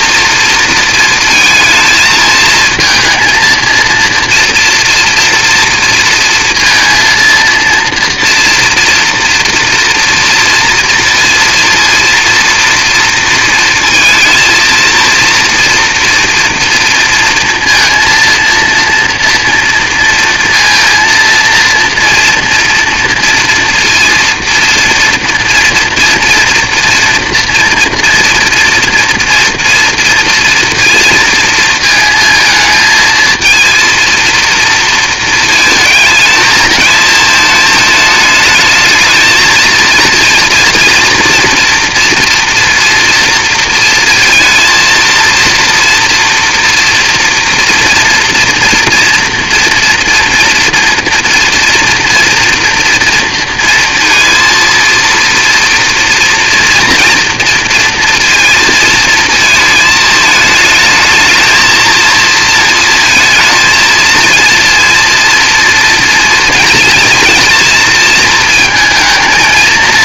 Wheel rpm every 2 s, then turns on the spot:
230, 220, 230, 230, 240, 230, 230, 230, 230, 230, 230, 230, 230, 230, 230, 230, 220, 230, 220, 220, 230, 240, 230, 230, 230, 230, 240, 230, 230, 230, 220, 230, 230, 230, 220.
none